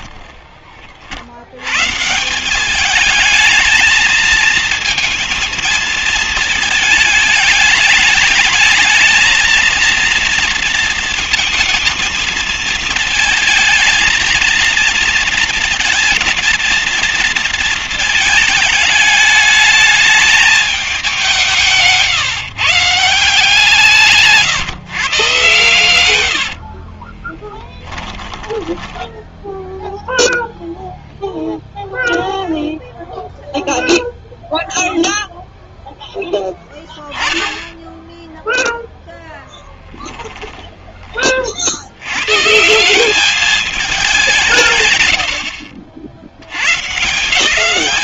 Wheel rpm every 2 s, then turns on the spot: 40, 210, 220, 220, 220, 230, 220, 230, 230, 210, 200, 160, 130, 50, 10, 0, 0, 0, 0, 0, 20, 170, 120, 150.
26-30